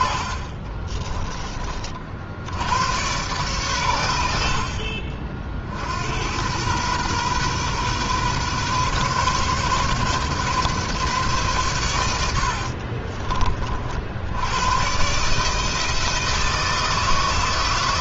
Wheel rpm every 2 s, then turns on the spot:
40, 80, 60, 100, 130, 140, 80, 100, 160.
0-2 12-14